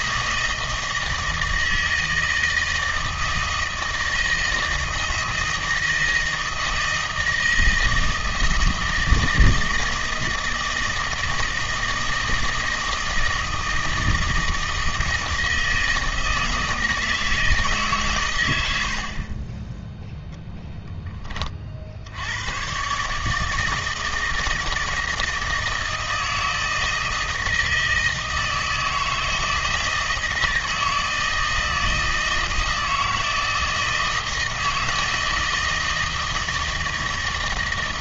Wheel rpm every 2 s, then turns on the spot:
160, 160, 160, 160, 160, 160, 160, 160, 160, 90, 0, 120, 160, 160, 160, 160, 160, 160, 160.
none